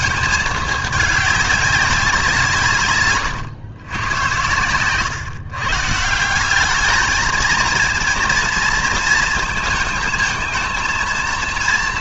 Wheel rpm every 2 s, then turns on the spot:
220, 150, 120, 200, 230, 220.
none